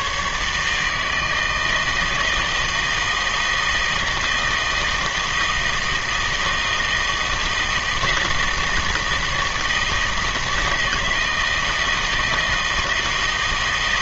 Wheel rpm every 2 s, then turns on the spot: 150, 160, 160, 160, 160, 160, 160.
none